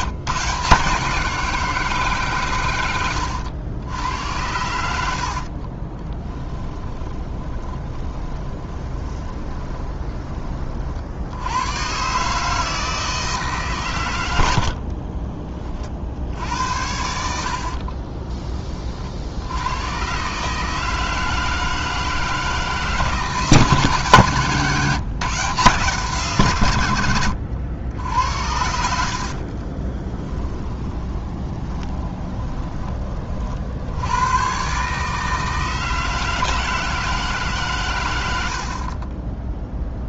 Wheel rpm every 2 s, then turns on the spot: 160, 110, 80, 10, 20, 40, 160, 60, 80, 30, 150, 150, 150, 110, 80, 20, 20, 140, 160, 40.
6-10 14-16 28-32 38-40